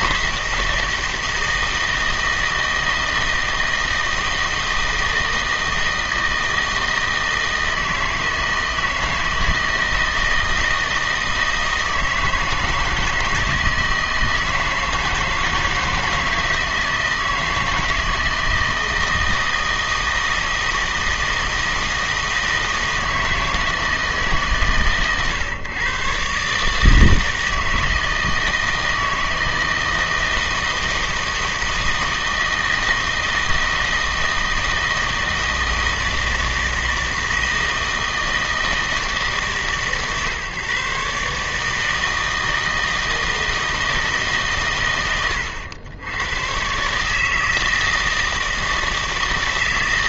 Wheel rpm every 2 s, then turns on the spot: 160, 160, 160, 160, 160, 160, 160, 160, 170, 160, 160, 160, 130, 150, 160, 160, 160, 160, 160, 160, 140, 160, 120, 130, 160.
none